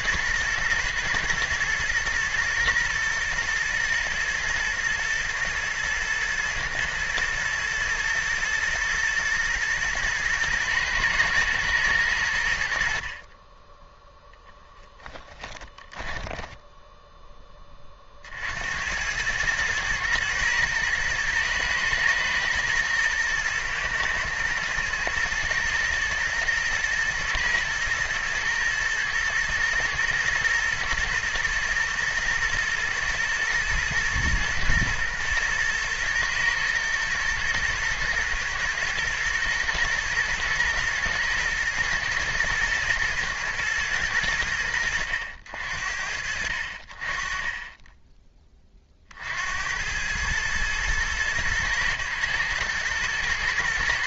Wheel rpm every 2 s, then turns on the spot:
110, 120, 120, 110, 110, 110, 60, 10, 10, 70, 110, 110, 110, 120, 110, 110, 120, 120, 110, 110, 110, 110, 90, 50, 30, 110, 110.
14-18